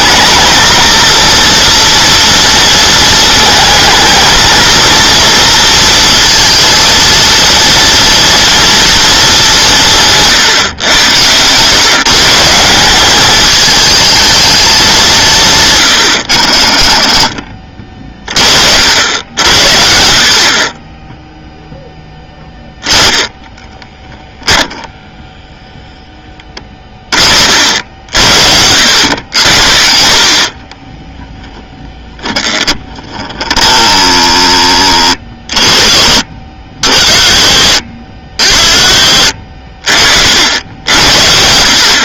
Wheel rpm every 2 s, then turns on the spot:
230, 230, 230, 220, 230, 130, 180, 210, 60, 50, 30, 10, 10, 20, 80, 30, 20, 20, 50, 40, 80.
30-32 38-40